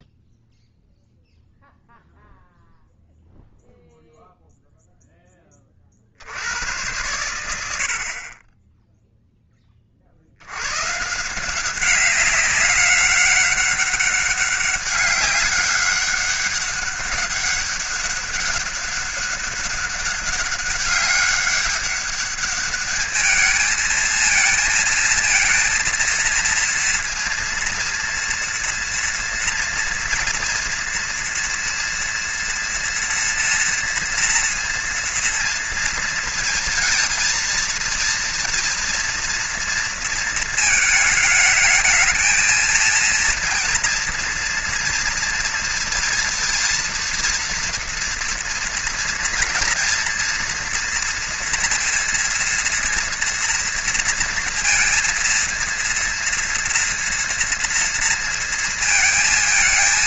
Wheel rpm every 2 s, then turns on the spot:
0, 0, 0, 80, 30, 80, 190, 200, 200, 200, 200, 200, 230, 230, 230, 230, 230, 230, 230, 230, 230, 220, 230, 230, 230, 230, 230, 230, 230, 230.
none